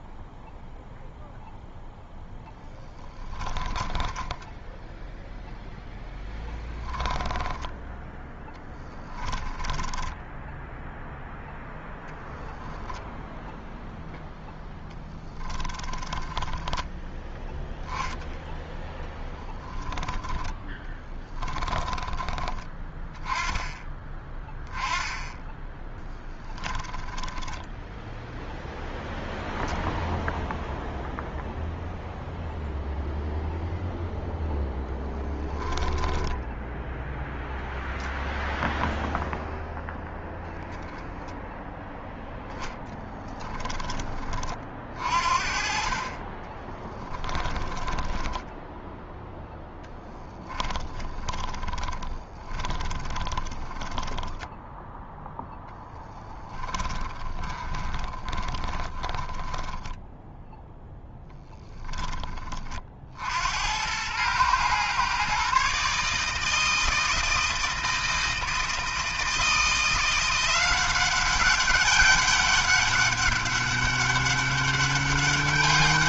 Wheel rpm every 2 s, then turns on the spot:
0, 10, 10, 10, 20, 0, 0, 10, 10, 10, 10, 20, 10, 10, 0, 0, 0, 10, 10, 0, 10, 10, 40, 20, 10, 10, 20, 10, 30, 20, 0, 30, 120, 160, 160, 180, 200, 200.
4-10 16-18 20-22 26-28 46-60